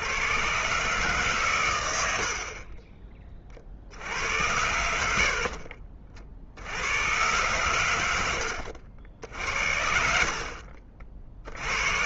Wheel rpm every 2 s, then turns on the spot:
130, 40, 80, 70, 80, 50.
8-12